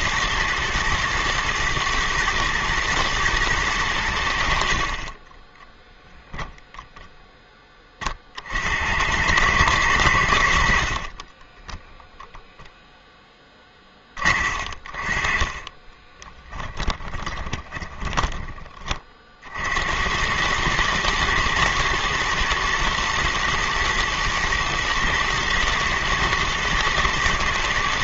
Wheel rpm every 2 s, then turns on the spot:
120, 110, 30, 10, 100, 30, 10, 30, 10, 40, 110, 110, 120, 110.
10-12 16-18